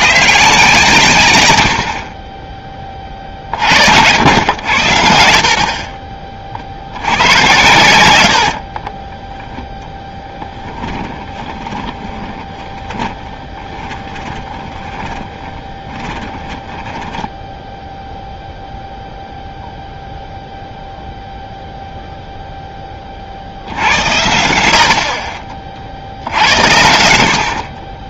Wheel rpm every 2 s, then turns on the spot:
150, 20, 80, 70, 30, 10, 20, 20, 10, 0, 0, 10, 70, 80.
8-18